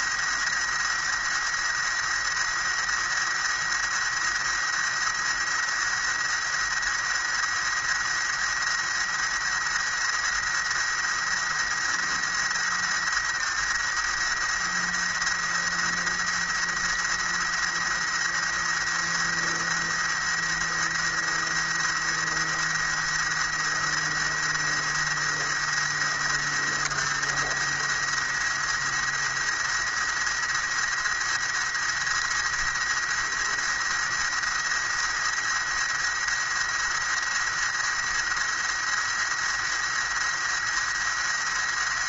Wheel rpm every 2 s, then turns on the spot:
110, 110, 110, 110, 110, 110, 110, 110, 110, 110, 110, 110, 110, 110, 110, 110, 110, 110, 110, 110, 110.
none